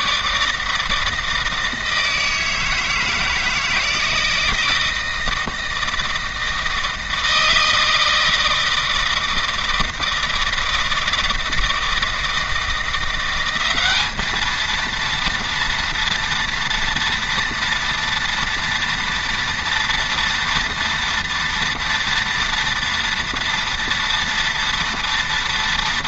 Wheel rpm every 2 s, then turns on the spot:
160, 160, 160, 160, 160, 160, 170, 230, 230, 230, 230, 230, 230.
none